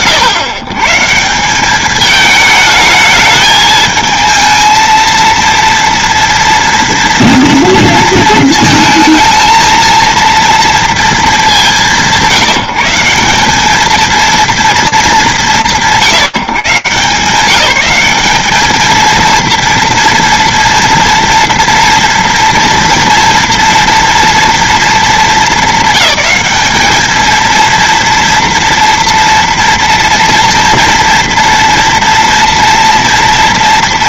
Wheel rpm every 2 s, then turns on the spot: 140, 220, 230, 230, 220, 230, 170, 200, 160, 220, 230, 230, 220, 220, 230, 230, 230.
none